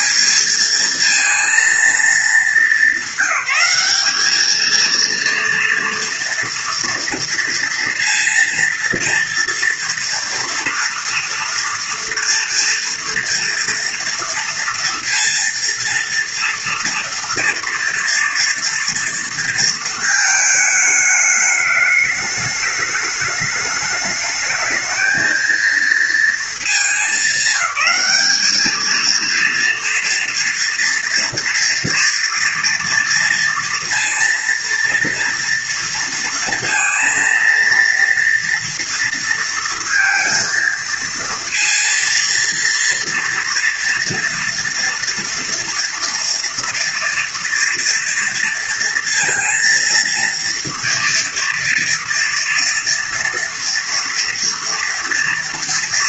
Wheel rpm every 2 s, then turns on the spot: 210, 210, 210, 230, 230, 230, 230, 240, 230, 230, 220, 210, 220, 220, 220, 230, 230, 230, 230, 230, 230, 230, 230, 230, 230, 230, 230, 230.
none